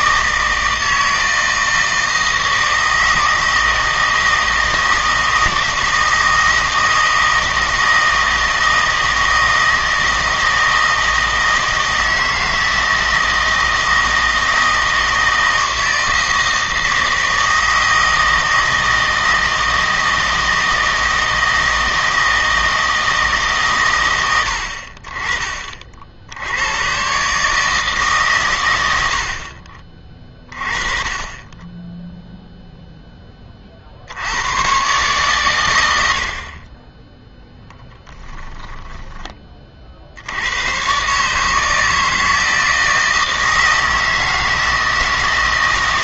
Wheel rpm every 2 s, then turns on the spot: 160, 160, 160, 160, 160, 160, 160, 160, 160, 160, 160, 160, 80, 100, 110, 30, 0, 110, 20, 10, 120, 160, 160.
38-40